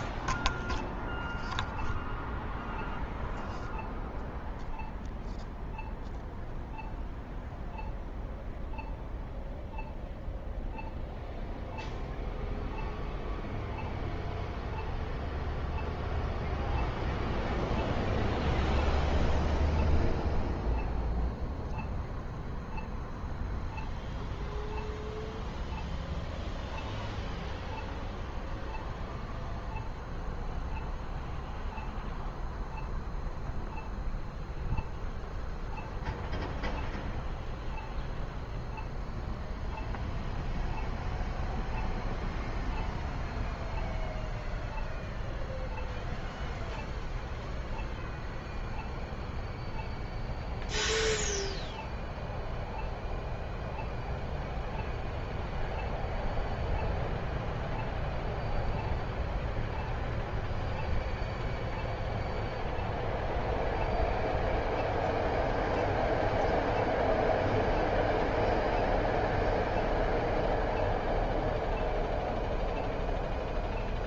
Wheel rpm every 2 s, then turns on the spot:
0, 0, 0, 0, 0, 0, 0, 0, 0, 0, 0, 0, 0, 0, 0, 0, 0, 0, 0, 0, 0, 0, 0, 0, 0, 0, 0, 0, 0, 0, 0, 0, 0, 0, 0, 0, 0.
none